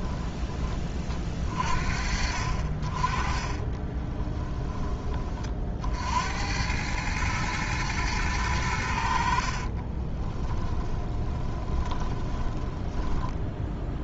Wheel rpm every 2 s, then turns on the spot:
20, 40, 10, 90, 90, 20, 20.
10-14